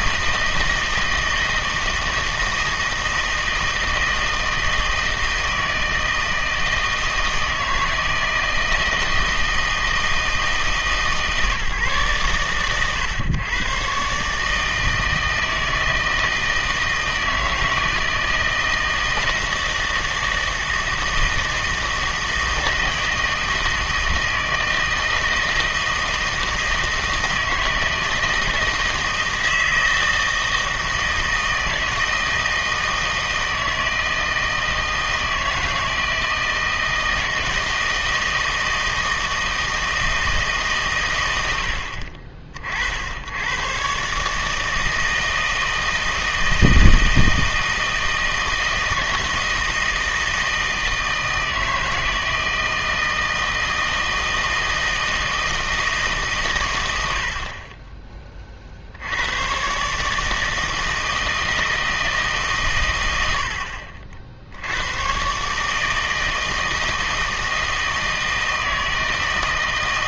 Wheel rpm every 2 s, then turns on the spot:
160, 160, 160, 160, 160, 150, 120, 160, 160, 160, 160, 160, 160, 160, 160, 160, 160, 160, 160, 160, 150, 50, 160, 160, 160, 160, 160, 160, 110, 50, 160, 130, 80, 160, 160.
none